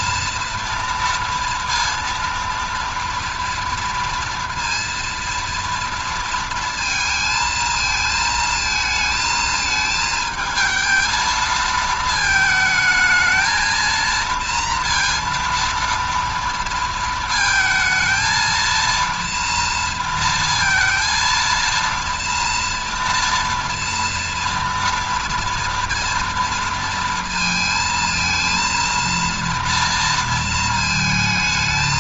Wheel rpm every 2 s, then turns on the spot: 230, 230, 230, 230, 220, 220, 220, 230, 230, 230, 230, 230, 230, 230, 230, 230.
none